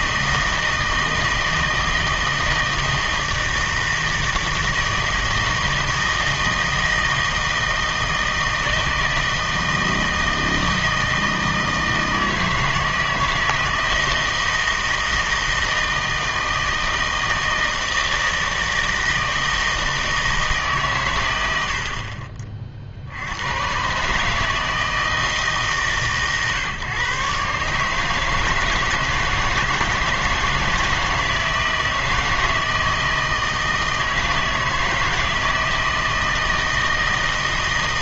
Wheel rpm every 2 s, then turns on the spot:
160, 160, 160, 160, 160, 160, 160, 160, 160, 160, 150, 50, 160, 140, 160, 160, 160, 160, 160.
none